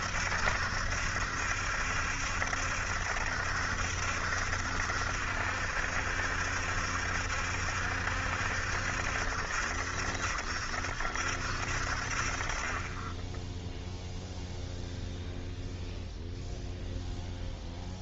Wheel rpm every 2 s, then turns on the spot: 70, 70, 70, 70, 70, 70, 30, 0, 0.
none